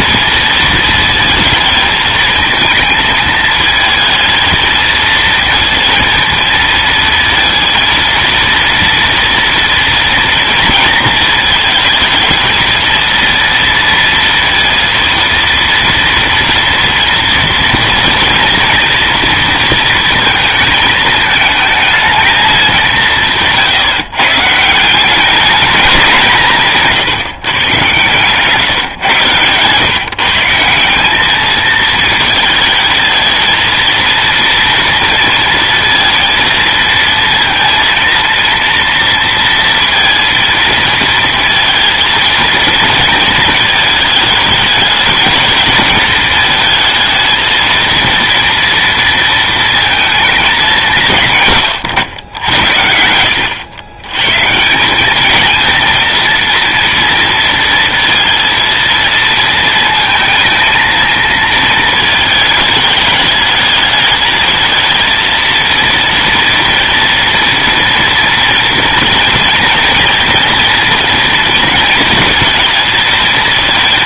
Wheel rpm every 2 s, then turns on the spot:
230, 220, 230, 230, 230, 230, 220, 230, 230, 230, 220, 190, 160, 150, 130, 180, 220, 230, 230, 230, 230, 230, 220, 220, 230, 190, 80, 170, 230, 230, 220, 220, 220, 230, 230, 230, 220.
none